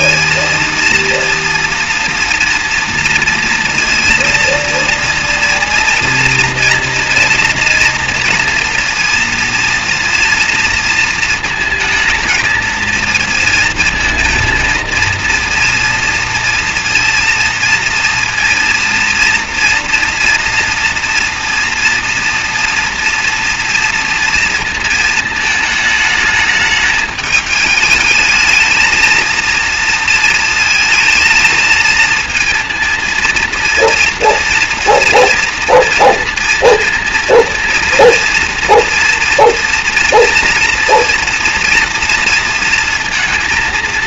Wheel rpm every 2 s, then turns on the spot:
230, 230, 230, 230, 230, 230, 220, 230, 230, 230, 230, 230, 230, 220, 220, 230, 230, 230, 230, 230, 240, 230.
none